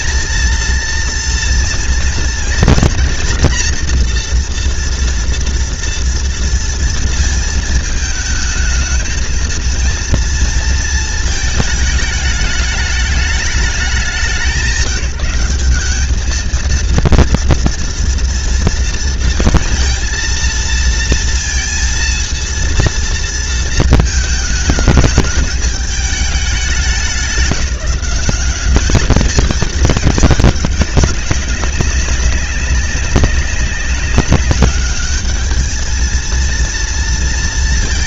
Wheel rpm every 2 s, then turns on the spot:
230, 230, 240, 230, 220, 230, 210, 180, 220, 230, 230, 230, 220, 190, 190, 210, 190, 190, 230.
none